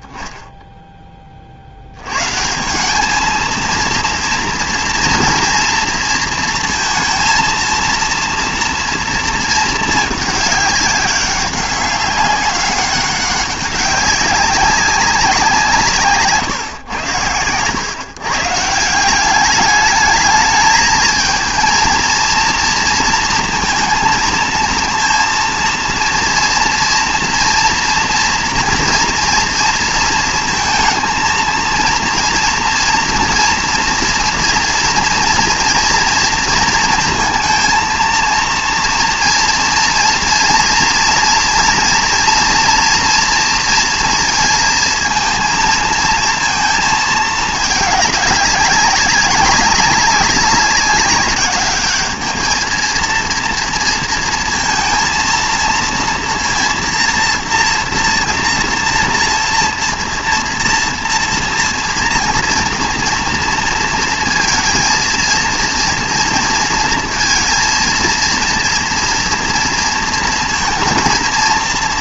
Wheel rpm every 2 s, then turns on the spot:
0, 160, 230, 230, 230, 210, 190, 190, 130, 150, 210, 230, 230, 230, 230, 230, 240, 240, 230, 230, 230, 240, 230, 220, 200, 200, 220, 230, 240, 230, 230, 230, 230, 230, 230, 230.
none